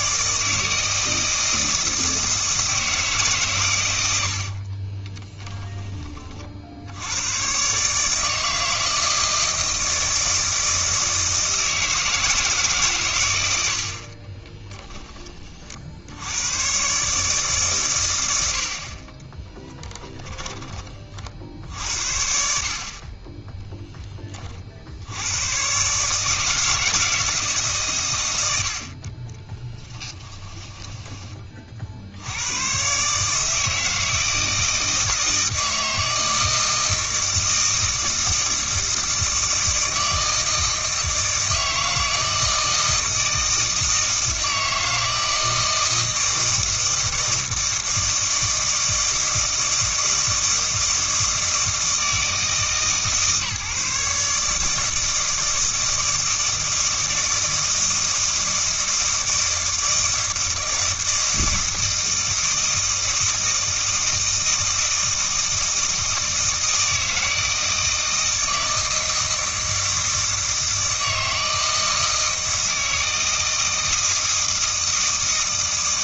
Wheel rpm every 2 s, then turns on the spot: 160, 160, 40, 70, 160, 160, 140, 10, 130, 50, 30, 40, 70, 160, 70, 10, 120, 160, 160, 160, 160, 160, 160, 160, 160, 160, 140, 160, 160, 160, 160, 160, 160, 160, 160, 160, 160, 160.
4-6 30-32